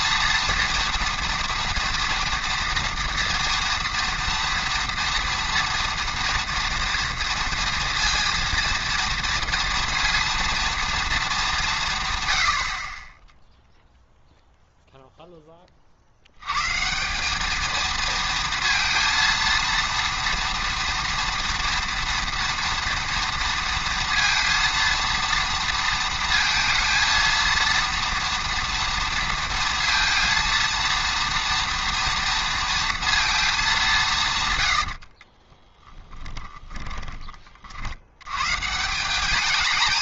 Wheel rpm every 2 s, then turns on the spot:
230, 230, 230, 230, 230, 230, 70, 0, 130, 230, 230, 230, 230, 230, 230, 230, 230, 100, 20, 150.
34-38